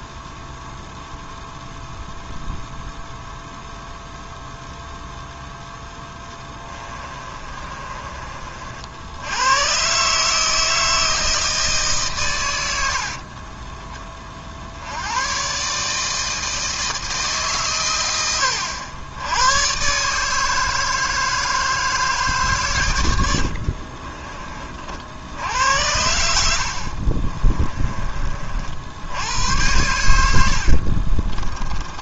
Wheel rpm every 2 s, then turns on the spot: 0, 0, 0, 20, 70, 160, 70, 80, 160, 80, 160, 110, 60, 50, 80, 60.
6-8 12-14 26-28 30-32